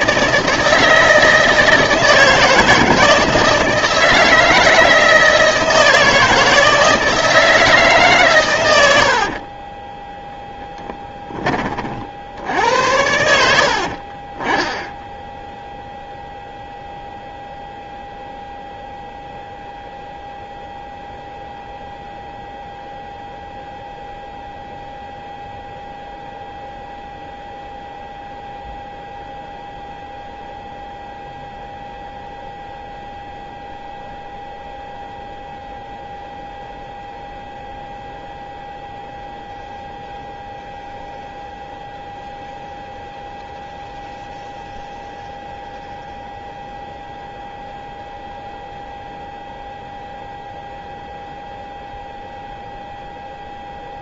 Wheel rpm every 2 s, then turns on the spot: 160, 160, 160, 160, 100, 10, 80, 10, 0, 0, 0, 0, 0, 0, 0, 0, 0, 0, 0, 0, 0, 0, 0, 0, 0, 0, 0.
none